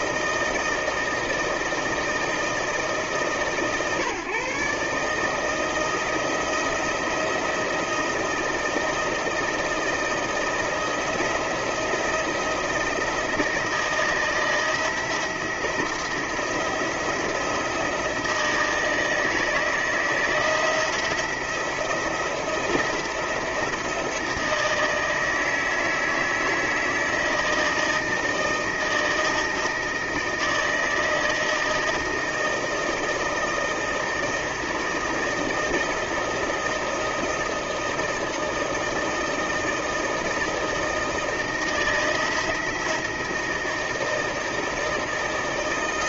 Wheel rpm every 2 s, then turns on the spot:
160, 160, 140, 170, 170, 170, 170, 160, 170, 170, 160, 170, 160, 160, 160, 160, 160, 160, 160, 160, 160, 160, 160.
none